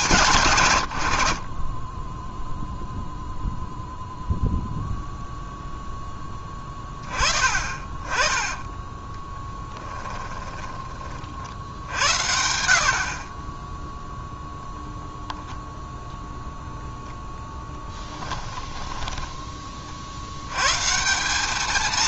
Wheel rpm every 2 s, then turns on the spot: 130, 0, 0, 10, 20, 10, 70, 0, 0, 10, 120.
8-10 18-20